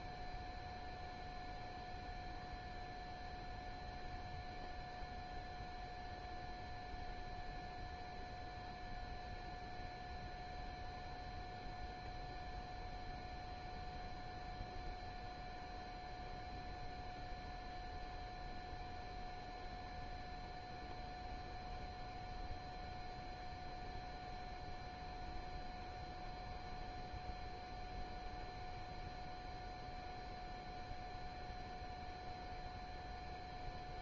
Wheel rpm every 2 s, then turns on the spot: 0, 0, 0, 0, 0, 0, 0, 0, 0, 0, 0, 0, 0, 0, 0, 0, 0.
none